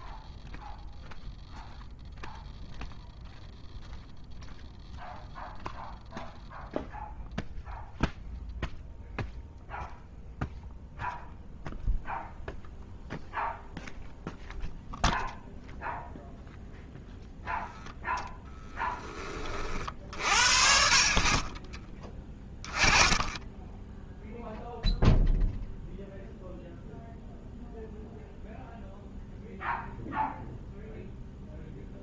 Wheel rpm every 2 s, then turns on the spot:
0, 0, 0, 0, 0, 0, 0, 0, 0, 10, 50, 20, 0, 0, 0, 0.
18-20